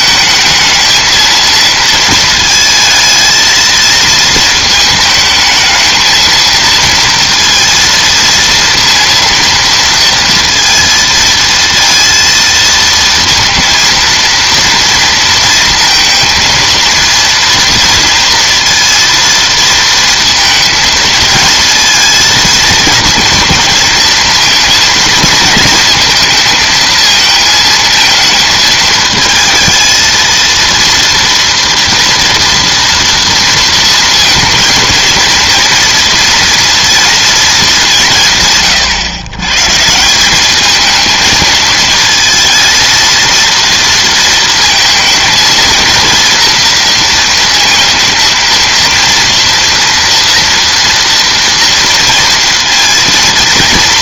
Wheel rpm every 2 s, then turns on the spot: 220, 220, 220, 230, 230, 230, 230, 230, 230, 230, 230, 220, 220, 220, 220, 230, 230, 230, 230, 140, 220, 220, 230, 230, 230, 230, 230.
none